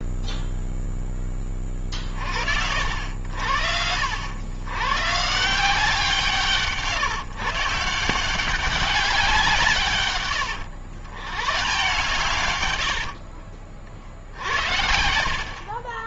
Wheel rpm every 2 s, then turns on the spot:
0, 60, 110, 170, 190, 110, 120, 60.
12-14